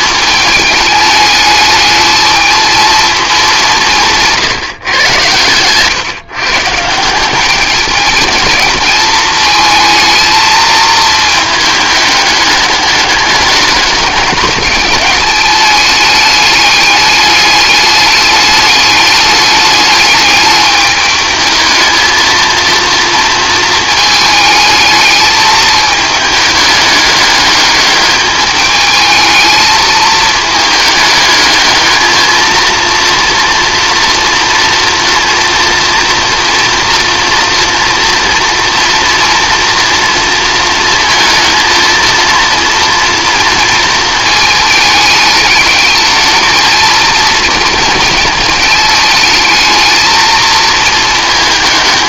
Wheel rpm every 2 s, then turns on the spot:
210, 220, 140, 150, 220, 220, 210, 210, 210, 210, 210, 230, 220, 210, 210, 220, 230, 230, 230, 230, 230, 230, 210, 220, 220, 220.
none